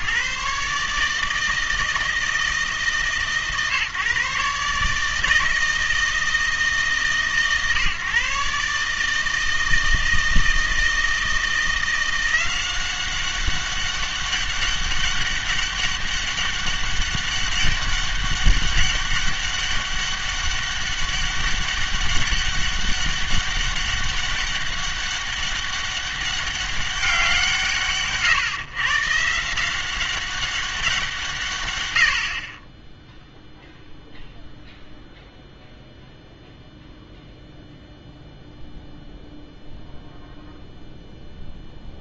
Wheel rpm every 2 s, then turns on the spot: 140, 160, 150, 150, 140, 160, 180, 200, 200, 200, 200, 200, 200, 200, 140, 190, 30, 0, 0, 0, 0.
none